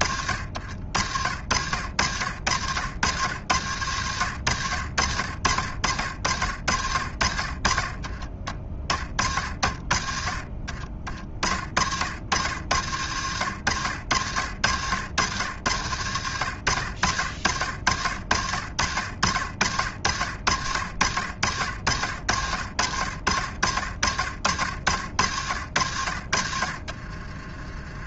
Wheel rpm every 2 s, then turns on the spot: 60, 80, 80, 70, 30, 40, 70, 60, 80, 60, 80, 70, 60, 60.
26-28